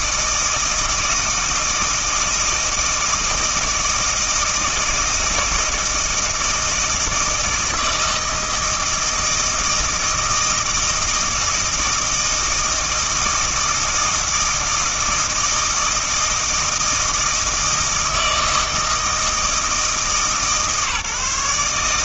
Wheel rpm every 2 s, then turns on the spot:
160, 160, 160, 160, 160, 160, 160, 160, 160, 160, 150.
none